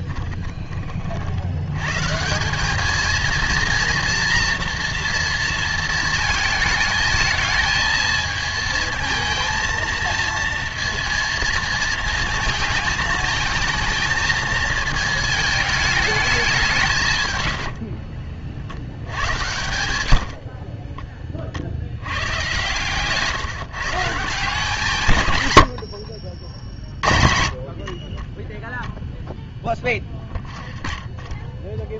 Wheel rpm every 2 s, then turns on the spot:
20, 200, 230, 220, 220, 230, 220, 220, 170, 50, 50, 120, 160, 60, 0, 10.
20-22 30-32